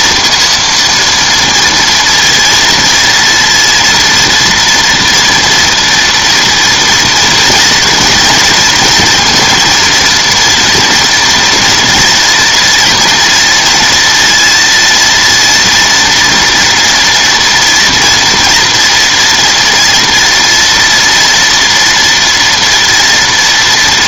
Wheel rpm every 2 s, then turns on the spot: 230, 230, 230, 240, 230, 230, 240, 230, 240, 230, 230, 240.
none